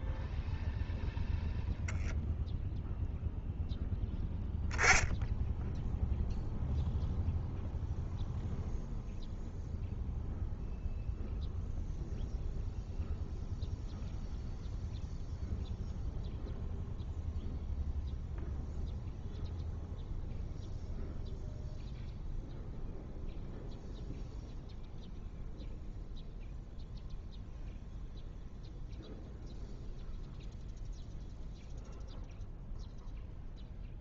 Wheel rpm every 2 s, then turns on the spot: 0, 0, 10, 0, 0, 0, 0, 0, 0, 0, 0, 0, 0, 0, 0, 0, 0.
none